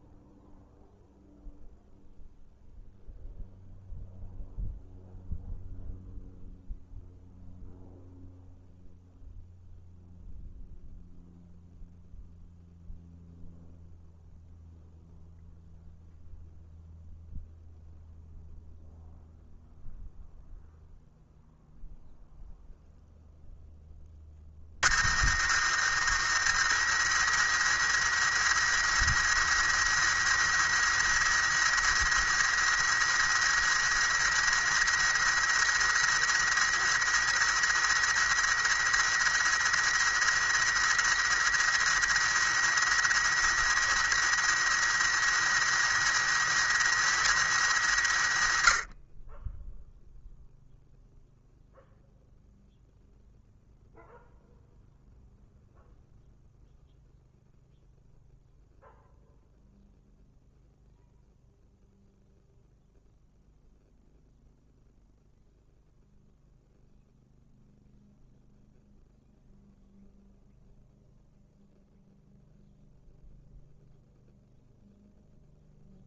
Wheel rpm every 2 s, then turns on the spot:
0, 0, 0, 0, 0, 0, 0, 0, 0, 0, 0, 0, 50, 110, 110, 110, 110, 110, 110, 110, 110, 110, 110, 110, 50, 0, 0, 0, 0, 0, 0, 0, 0, 0, 0, 0, 0, 0.
none